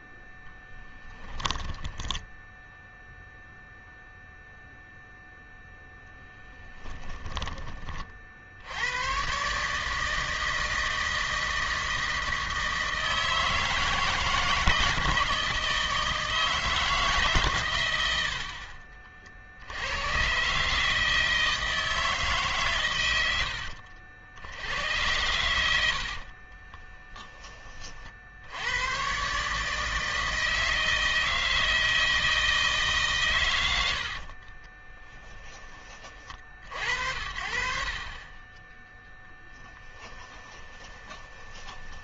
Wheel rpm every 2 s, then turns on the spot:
10, 0, 0, 20, 90, 160, 160, 160, 160, 50, 150, 120, 90, 20, 110, 160, 150, 20, 60, 10, 20.
0-2 6-8 18-20 26-28 34-36 40-42